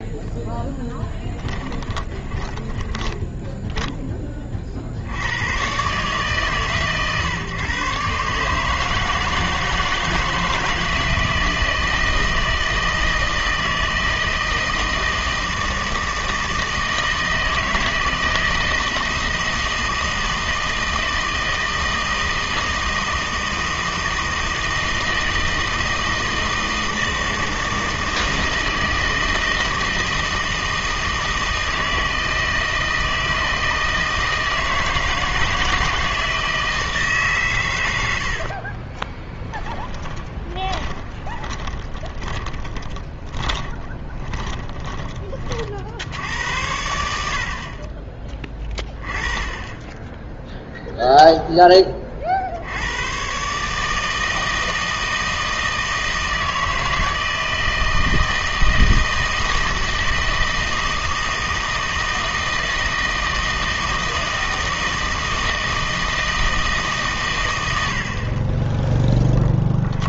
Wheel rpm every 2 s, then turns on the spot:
10, 20, 50, 130, 150, 160, 160, 160, 160, 160, 160, 160, 160, 160, 160, 160, 160, 160, 160, 30, 10, 20, 20, 80, 20, 0, 80, 160, 160, 160, 160, 160, 160, 150, 10.
0-4 38-46